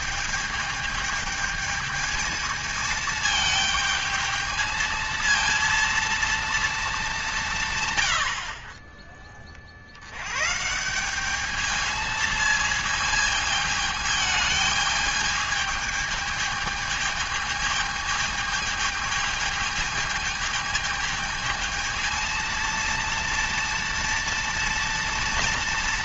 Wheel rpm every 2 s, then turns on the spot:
220, 220, 220, 210, 30, 170, 220, 220, 210, 220, 220, 230, 230.
none